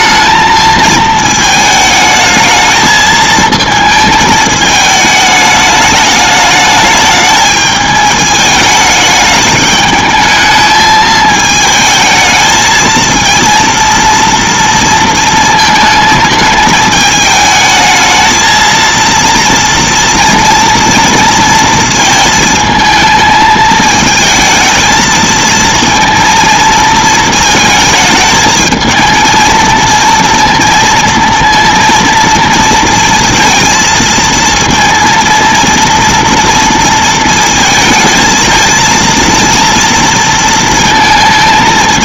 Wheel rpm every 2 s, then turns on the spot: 220, 220, 220, 210, 210, 220, 220, 230, 210, 230, 230, 220, 220, 220, 220, 230, 230, 230, 230, 230, 230.
none